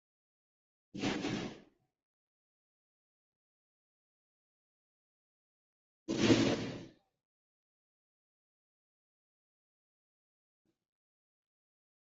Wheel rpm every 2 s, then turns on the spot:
0, 0, 0, 0, 0, 0.
none